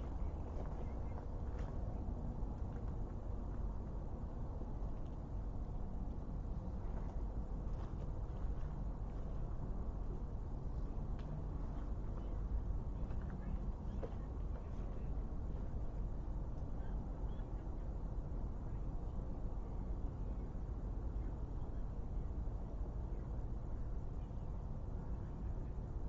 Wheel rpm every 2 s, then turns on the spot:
0, 0, 0, 0, 0, 0, 0, 0, 0, 0, 0, 0, 0.
none